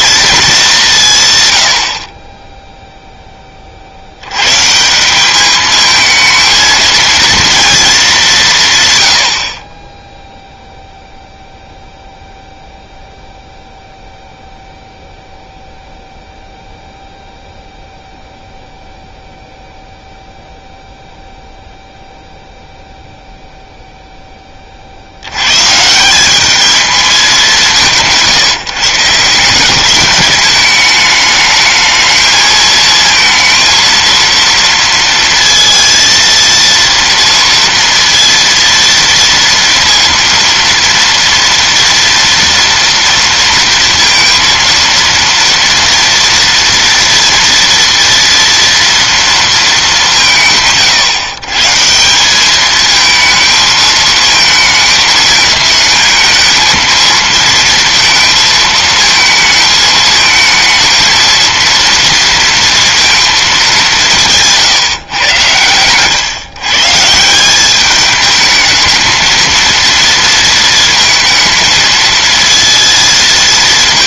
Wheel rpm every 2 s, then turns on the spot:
200, 0, 140, 230, 130, 0, 0, 0, 0, 0, 0, 0, 30, 210, 160, 210, 220, 230, 230, 230, 230, 230, 230, 230, 230, 150, 210, 220, 220, 220, 220, 230, 160, 130, 220, 230, 230.
none